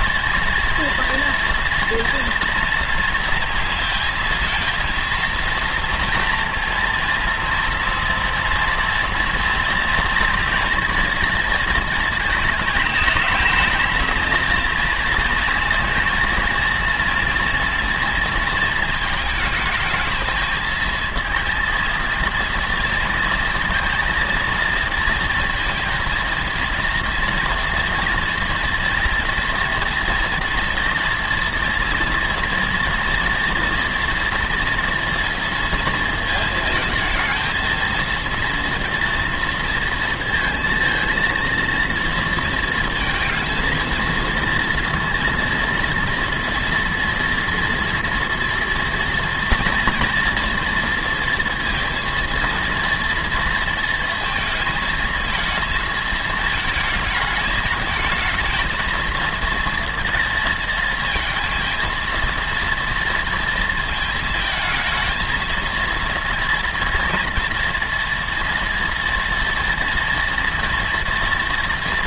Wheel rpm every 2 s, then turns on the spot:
230, 230, 230, 230, 230, 230, 220, 230, 230, 220, 230, 230, 230, 230, 230, 230, 230, 230, 230, 240, 230, 230, 230, 240, 240, 230, 230, 220, 220, 220, 230, 230, 230, 230, 230, 230.
none